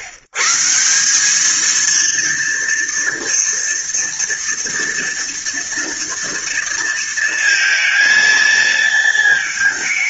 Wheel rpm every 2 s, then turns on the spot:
140, 230, 230, 230, 230.
none